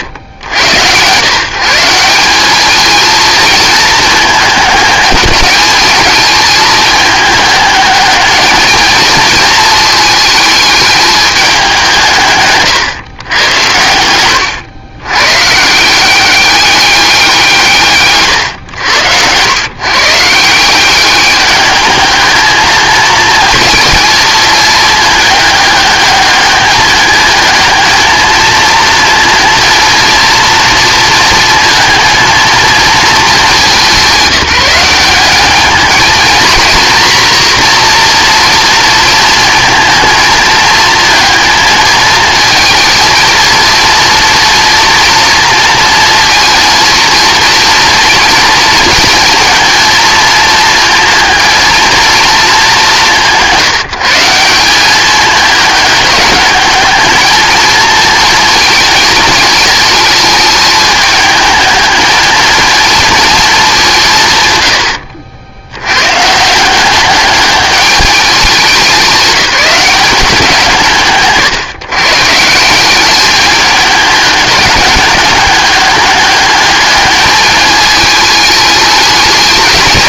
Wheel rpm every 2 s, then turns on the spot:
100, 220, 210, 210, 220, 220, 140, 110, 200, 100, 180, 220, 220, 210, 230, 230, 230, 190, 230, 230, 220, 230, 230, 230, 220, 230, 190, 190, 210, 230, 210, 230, 100, 180, 190, 170, 180, 210, 210, 210.
64-66